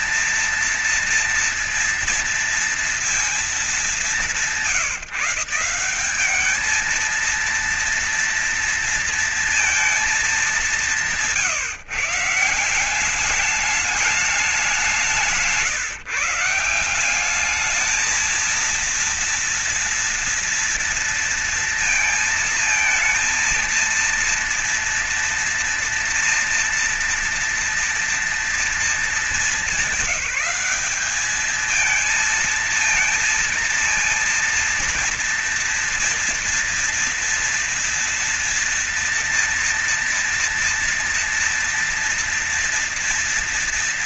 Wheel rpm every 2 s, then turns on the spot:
230, 230, 180, 220, 230, 180, 190, 170, 180, 230, 230, 220, 230, 230, 220, 200, 230, 230, 230, 230, 230, 240.
none